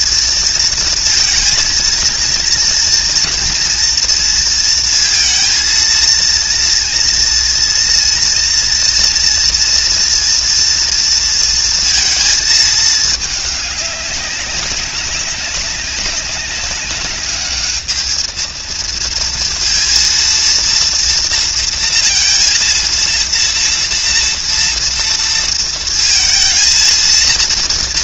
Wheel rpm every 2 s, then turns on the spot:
230, 230, 230, 230, 240, 230, 220, 200, 200, 230, 240, 230, 230, 230.
none